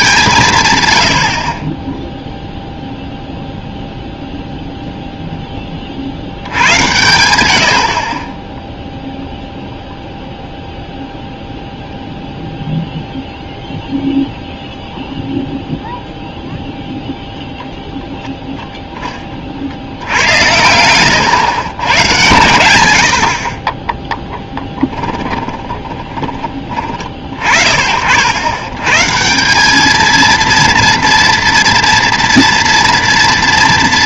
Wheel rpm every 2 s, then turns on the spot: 120, 0, 0, 90, 0, 0, 0, 0, 0, 0, 100, 90, 10, 30, 120, 230, 230.
24-26